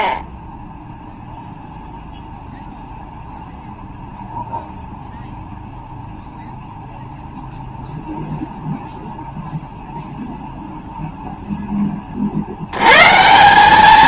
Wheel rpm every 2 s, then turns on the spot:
0, 0, 0, 0, 0, 0, 100.
none